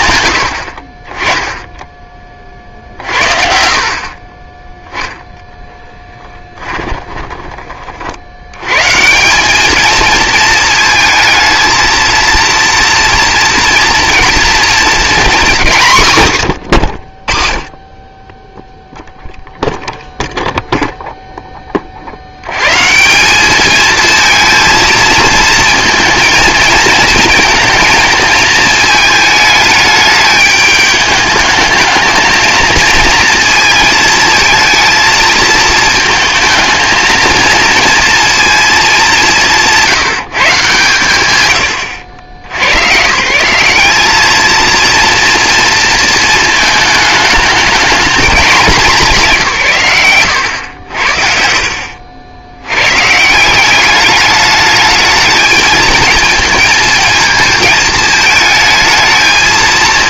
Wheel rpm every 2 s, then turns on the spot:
30, 60, 0, 20, 200, 230, 230, 230, 40, 0, 10, 200, 230, 230, 220, 210, 220, 220, 230, 180, 120, 170, 230, 210, 150, 60, 170, 220, 220, 220.
6-8